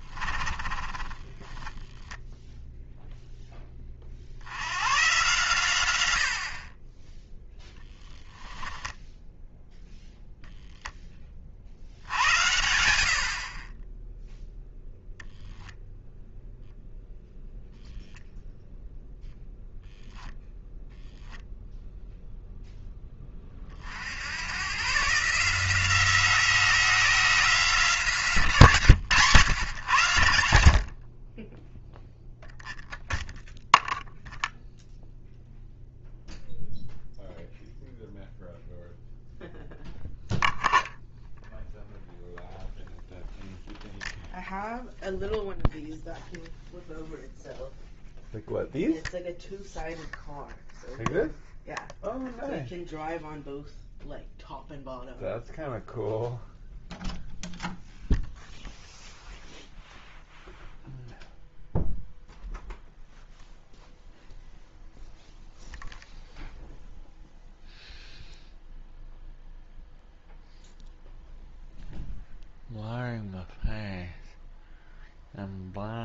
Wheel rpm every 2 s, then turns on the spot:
20, 0, 100, 40, 10, 10, 70, 0, 0, 0, 0, 0, 120, 180, 140, 50, 0, 0, 0, 0, 0, 0, 0, 0, 0, 0, 0, 0, 0, 0, 0, 0, 0, 0, 0, 0, 0, 0.
0-2 8-10